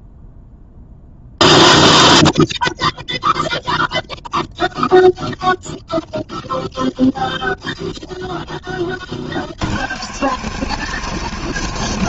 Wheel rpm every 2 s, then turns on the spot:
0, 0, 0, 0, 40, 150.
none